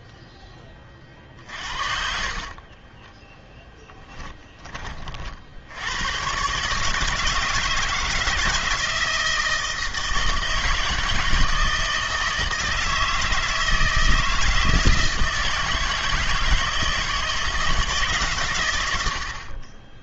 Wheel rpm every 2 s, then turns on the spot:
30, 10, 20, 150, 160, 160, 160, 160, 160, 110.
2-4